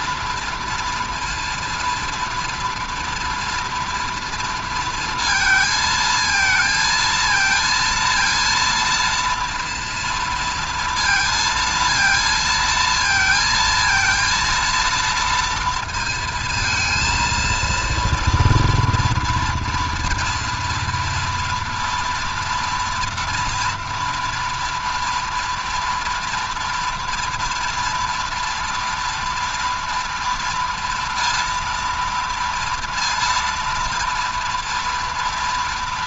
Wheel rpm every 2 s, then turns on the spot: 230, 230, 230, 220, 230, 230, 230, 230, 230, 230, 230, 230, 230, 230, 230, 230, 230, 230.
none